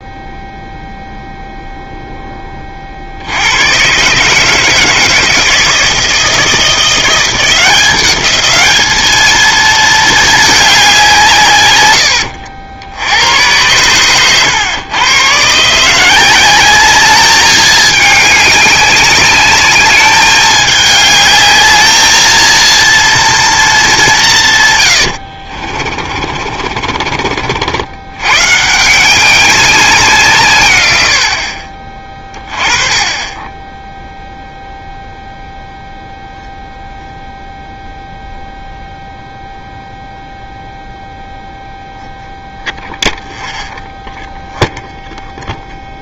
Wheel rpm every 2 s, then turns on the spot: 0, 10, 150, 160, 210, 210, 80, 110, 190, 200, 210, 220, 160, 50, 130, 140, 20, 0, 0, 0, 0, 0, 0.
26-28